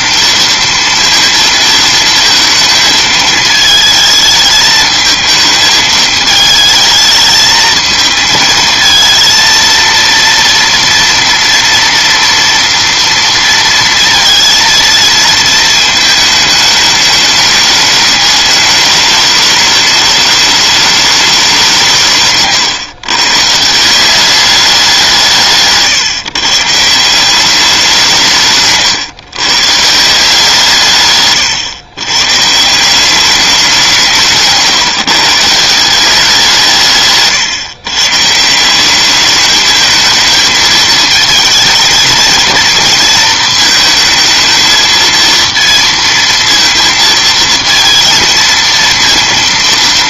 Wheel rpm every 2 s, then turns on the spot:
230, 220, 220, 220, 220, 230, 230, 230, 210, 210, 210, 130, 200, 150, 150, 160, 160, 150, 160, 180, 220, 230, 230, 230, 230.
none